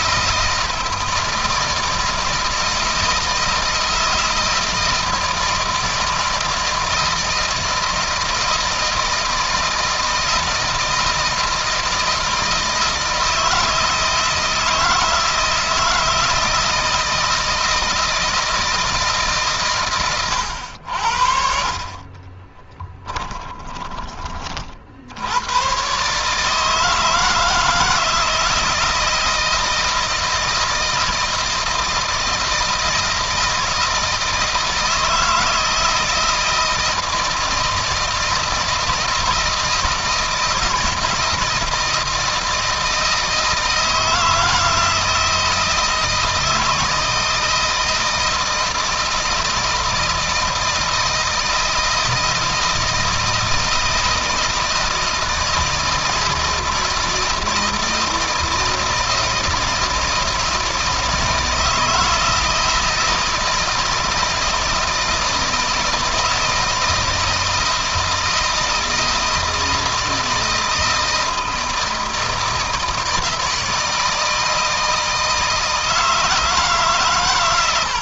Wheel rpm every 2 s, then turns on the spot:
160, 160, 160, 160, 160, 160, 160, 160, 160, 150, 70, 20, 70, 160, 160, 170, 160, 160, 160, 160, 160, 160, 160, 160, 160, 160, 160, 160, 160, 160, 160, 160, 160, 160, 160, 160, 160, 160, 140.
22-24